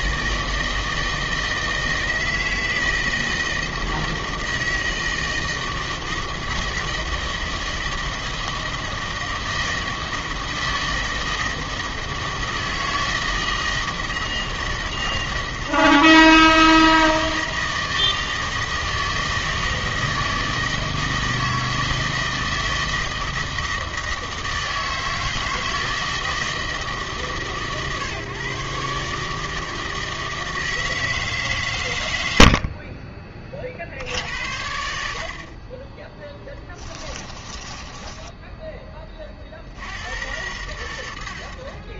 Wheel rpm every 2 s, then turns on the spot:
160, 160, 160, 160, 160, 160, 160, 160, 160, 160, 160, 160, 160, 150, 140, 160, 40, 70, 20, 20, 80.
36-38